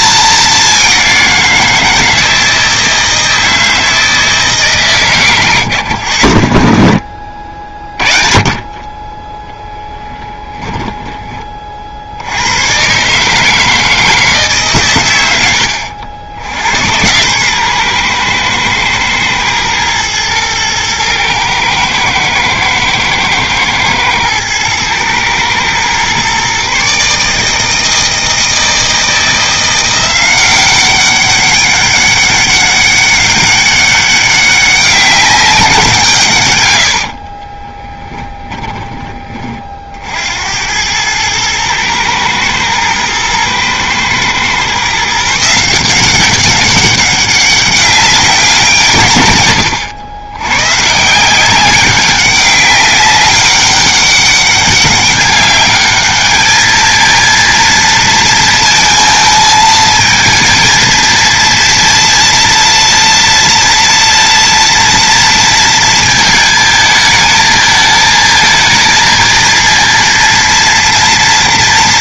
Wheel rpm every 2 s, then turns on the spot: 190, 160, 140, 50, 30, 10, 130, 120, 100, 110, 110, 110, 110, 140, 160, 190, 200, 190, 80, 20, 100, 120, 140, 190, 150, 140, 200, 200, 220, 220, 230, 230, 230, 220, 220, 230.
10-12 36-38